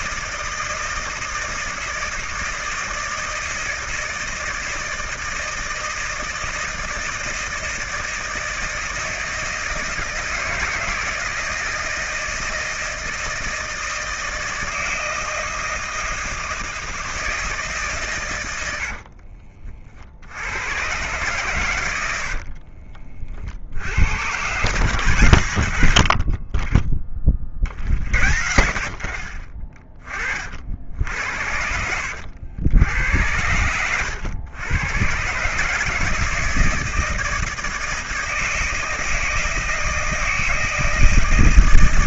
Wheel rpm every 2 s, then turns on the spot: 160, 160, 160, 160, 160, 160, 160, 160, 160, 80, 120, 50, 120, 20, 60, 60, 90, 120, 160, 160, 160.
22-24